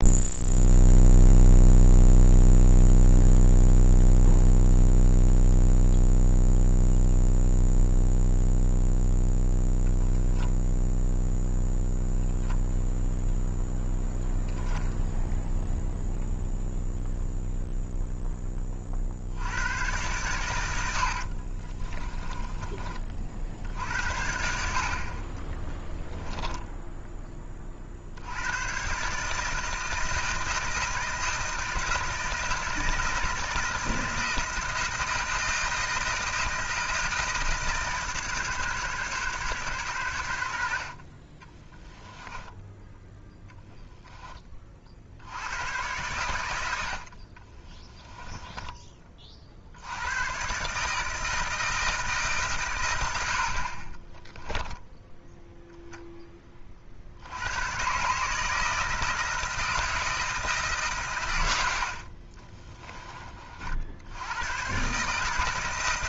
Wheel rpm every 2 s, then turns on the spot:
0, 0, 0, 0, 0, 0, 0, 10, 0, 20, 110, 30, 60, 10, 100, 160, 160, 160, 160, 140, 70, 10, 30, 90, 10, 130, 140, 10, 30, 160, 150, 30, 130.
26-28 48-50 54-56 62-64